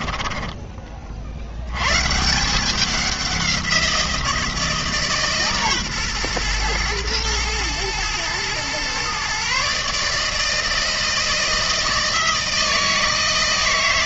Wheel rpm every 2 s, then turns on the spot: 30, 190, 160, 120, 120, 160, 160.
none